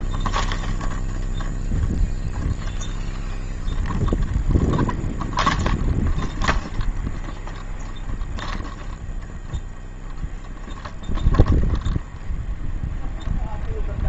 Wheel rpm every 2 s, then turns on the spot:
0, 0, 0, 0, 0, 0, 0.
none